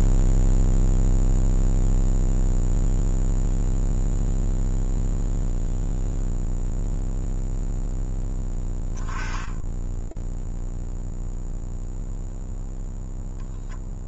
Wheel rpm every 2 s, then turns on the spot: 0, 0, 0, 0, 10, 0, 0.
none